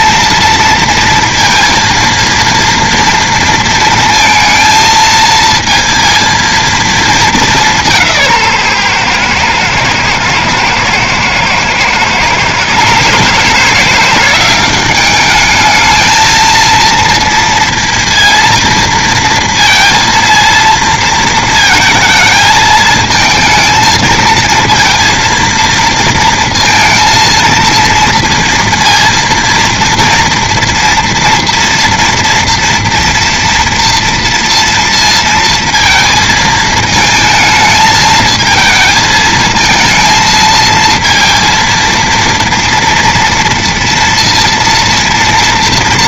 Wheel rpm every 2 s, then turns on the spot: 230, 230, 230, 230, 150, 110, 130, 190, 230, 230, 230, 220, 230, 230, 230, 230, 230, 230, 220, 220, 220, 230, 230.
none